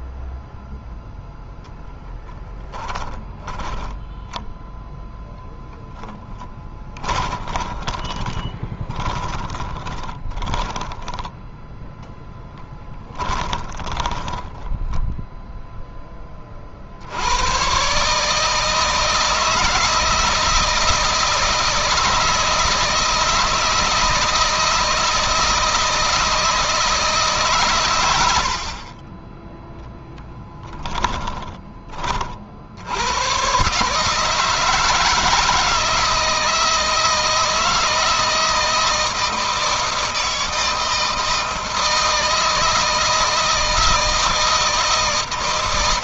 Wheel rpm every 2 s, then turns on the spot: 0, 20, 0, 20, 40, 10, 20, 10, 60, 160, 160, 160, 160, 160, 40, 20, 90, 160, 160, 160, 160, 160, 160.
2-4 6-16 28-32